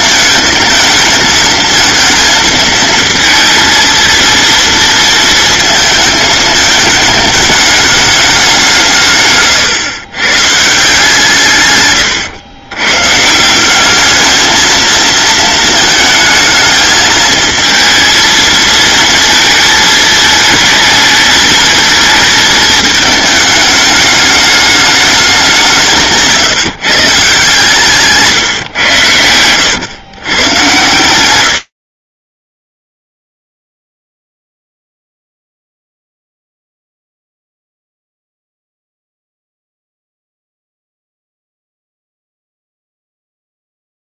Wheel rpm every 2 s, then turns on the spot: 220, 220, 230, 220, 180, 160, 110, 220, 220, 230, 220, 220, 210, 150, 120, 110, 10, 0, 0, 0, 0, 0.
none